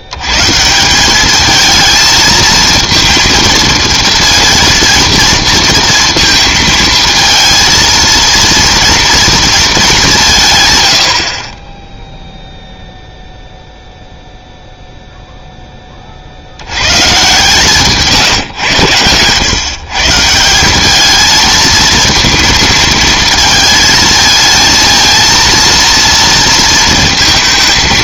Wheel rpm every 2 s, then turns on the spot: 180, 230, 230, 220, 230, 100, 0, 0, 90, 110, 190, 230, 220, 230.
none